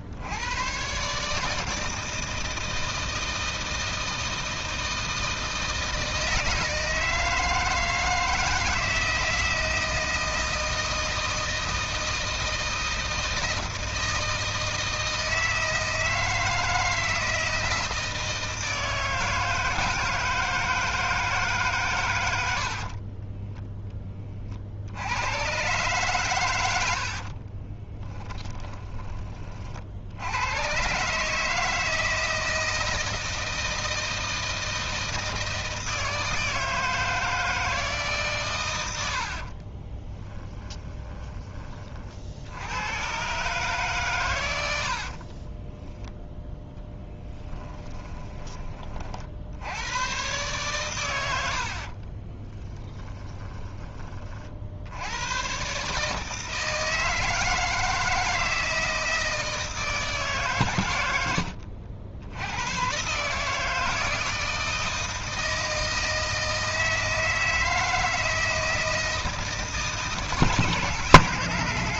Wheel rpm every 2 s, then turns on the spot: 120, 160, 160, 160, 160, 160, 160, 160, 160, 160, 160, 60, 60, 80, 20, 120, 160, 160, 160, 90, 10, 90, 90, 10, 30, 110, 10, 80, 160, 160, 120, 110, 160, 160, 160, 150.
22-24 28-30 40-42 52-54